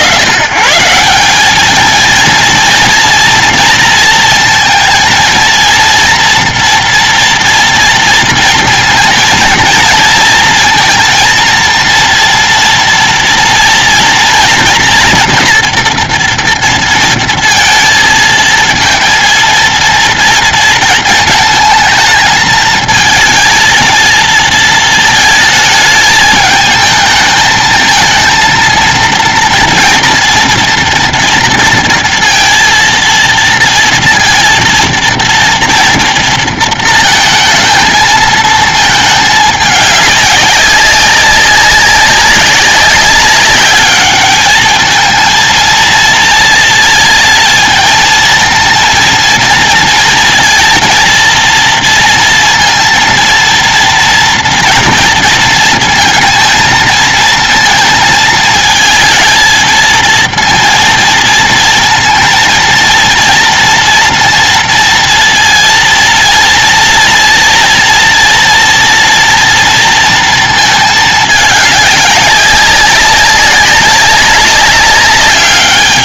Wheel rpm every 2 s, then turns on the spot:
140, 240, 230, 230, 230, 230, 230, 230, 230, 230, 220, 220, 220, 220, 230, 230, 230, 230, 230, 220, 200, 190, 220, 230, 230, 230, 230, 230, 220, 220, 230, 230, 230, 230, 230, 220, 200, 200.
none